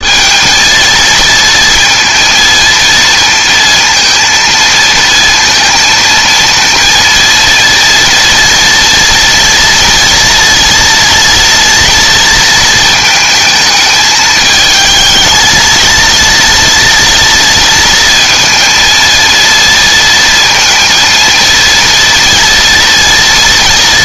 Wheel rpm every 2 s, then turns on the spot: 230, 230, 230, 230, 230, 230, 220, 220, 230, 230, 230, 240.
none